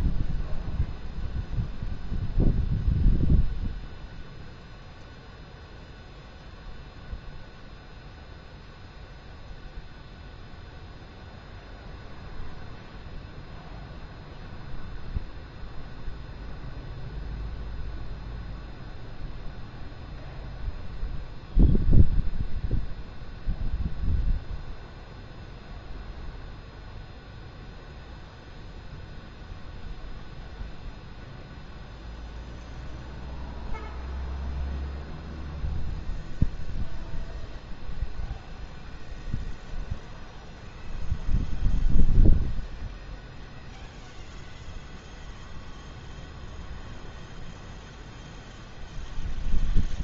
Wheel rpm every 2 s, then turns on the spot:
0, 0, 0, 0, 0, 0, 0, 0, 0, 0, 0, 0, 0, 0, 0, 0, 0, 0, 0, 0, 0, 0, 0, 0, 0.
none